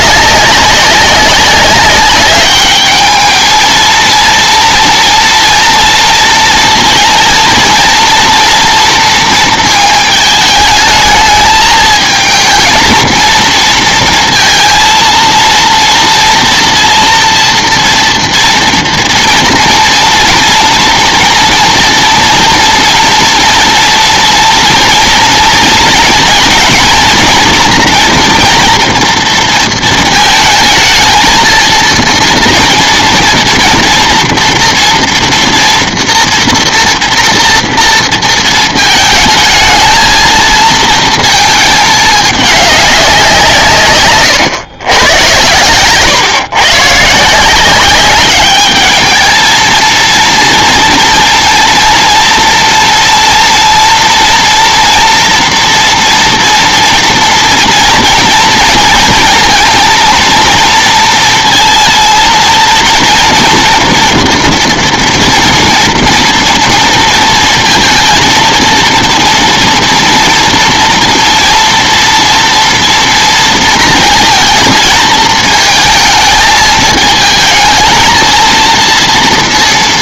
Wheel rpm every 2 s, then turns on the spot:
190, 210, 230, 230, 240, 210, 220, 230, 230, 230, 240, 240, 240, 230, 230, 220, 230, 230, 230, 220, 230, 200, 120, 140, 210, 230, 230, 230, 230, 230, 230, 230, 240, 230, 230, 240, 230, 220, 220, 230.
none